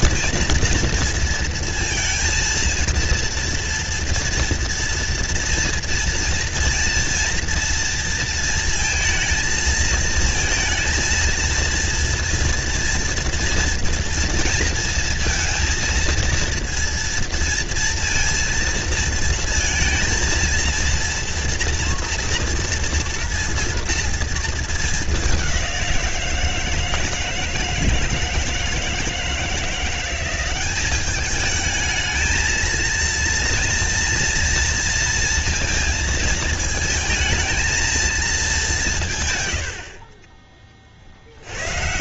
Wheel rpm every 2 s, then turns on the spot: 230, 230, 240, 230, 230, 230, 230, 230, 230, 230, 230, 230, 220, 170, 160, 190, 220, 230, 220, 210, 30.
none